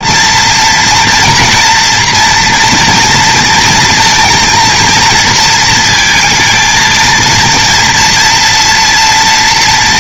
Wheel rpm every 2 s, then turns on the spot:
240, 230, 230, 230, 240.
none